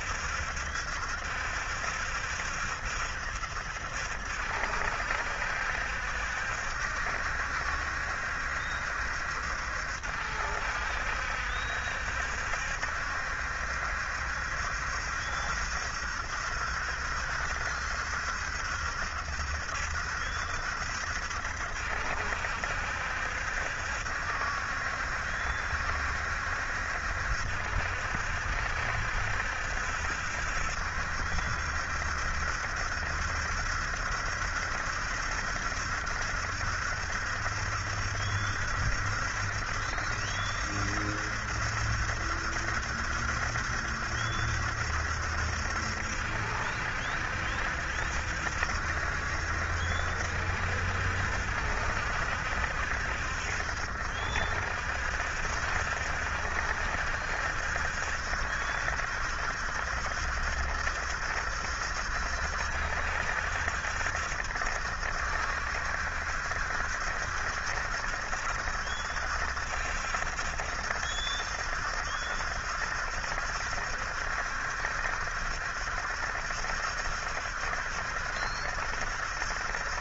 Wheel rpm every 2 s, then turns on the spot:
70, 70, 70, 70, 70, 70, 70, 70, 70, 70, 70, 70, 70, 70, 70, 70, 70, 70, 70, 70, 70, 70, 70, 70, 70, 70, 60, 60, 70, 70, 70, 70, 70, 70, 70, 70, 70, 70, 70, 70.
none